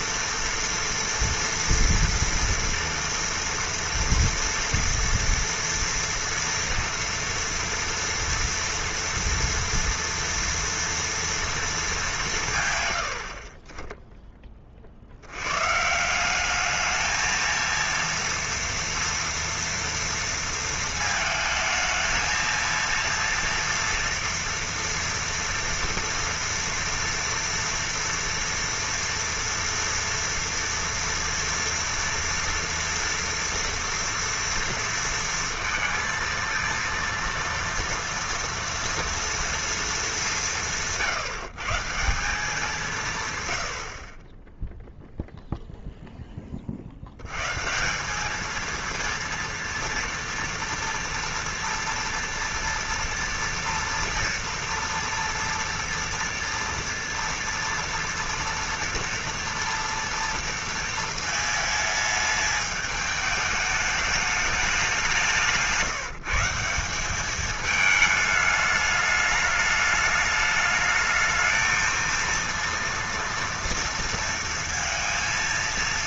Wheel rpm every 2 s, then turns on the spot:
240, 240, 240, 230, 230, 230, 160, 20, 200, 230, 230, 230, 230, 230, 230, 230, 230, 230, 230, 230, 180, 180, 10, 40, 230, 230, 230, 230, 240, 230, 230, 210, 200, 170, 210, 210, 230, 230.
44-46